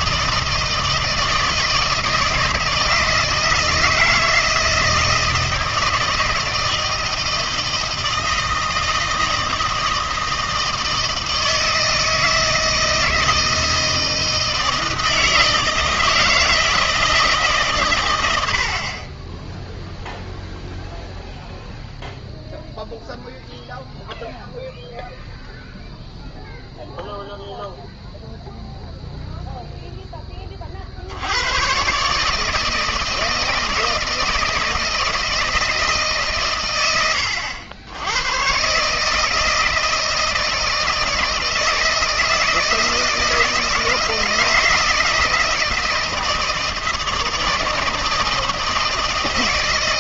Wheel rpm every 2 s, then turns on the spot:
160, 160, 160, 160, 160, 160, 160, 160, 160, 90, 0, 0, 0, 0, 0, 20, 150, 160, 130, 120, 160, 160, 160, 160, 160.
none